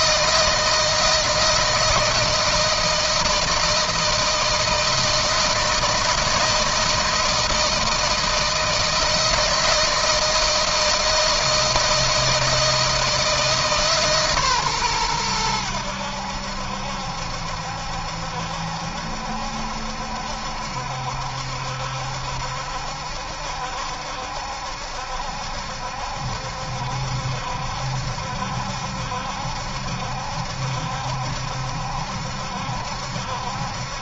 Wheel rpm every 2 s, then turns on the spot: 160, 160, 160, 160, 160, 160, 160, 140, 80, 70, 70, 70, 70, 70, 70, 70, 70.
none